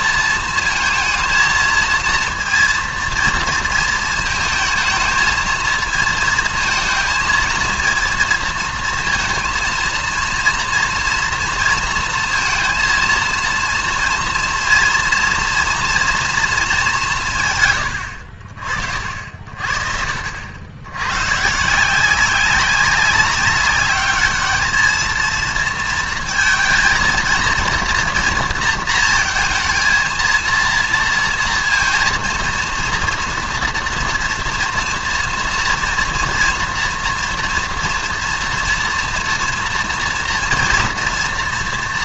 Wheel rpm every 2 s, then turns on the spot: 230, 230, 220, 230, 230, 230, 230, 230, 230, 70, 90, 190, 210, 230, 230, 230, 230, 230, 230, 230, 230.
none